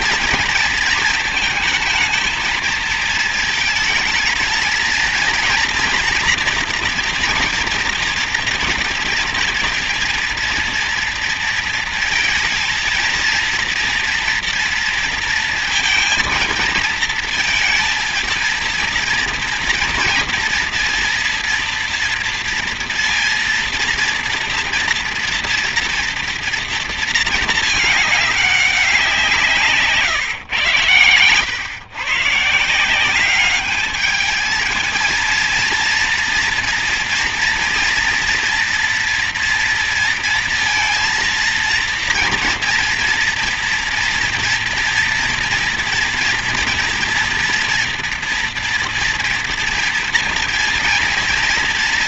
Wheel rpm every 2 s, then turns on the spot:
220, 220, 220, 230, 230, 230, 230, 230, 230, 230, 230, 230, 230, 230, 200, 110, 160, 220, 230, 230, 230, 230, 230, 230, 230, 230.
none